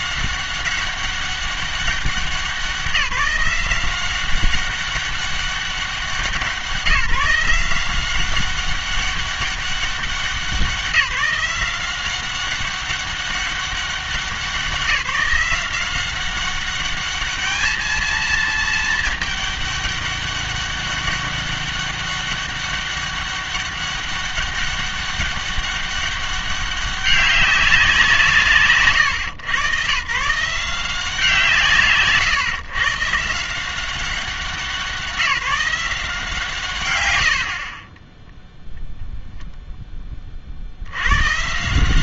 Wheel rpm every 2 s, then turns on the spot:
190, 190, 200, 180, 190, 180, 190, 180, 200, 220, 200, 200, 200, 200, 140, 160, 140, 190, 140, 0, 60.
36-38